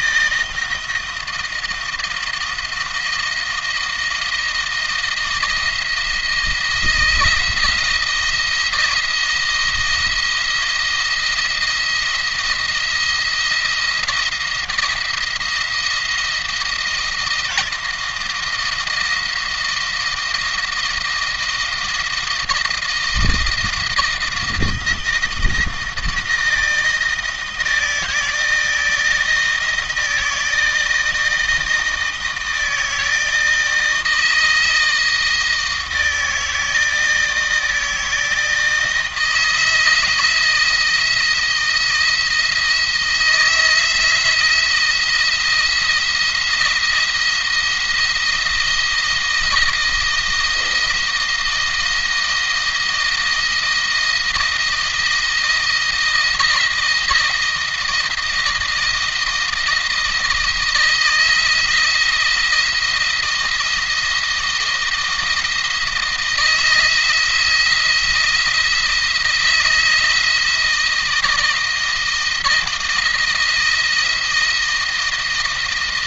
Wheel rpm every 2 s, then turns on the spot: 170, 170, 170, 160, 170, 170, 170, 170, 170, 170, 170, 160, 160, 160, 160, 160, 160, 160, 160, 160, 160, 160, 170, 170, 170, 170, 170, 170, 160, 170, 160, 170, 170, 170, 170, 160, 170, 170.
none